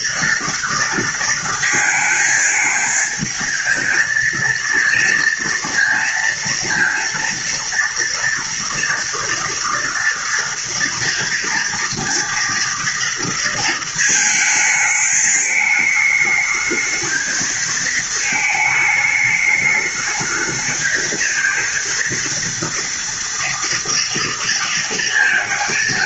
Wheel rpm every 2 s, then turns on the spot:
230, 220, 230, 230, 230, 240, 230, 220, 220, 220, 220, 230, 230.
none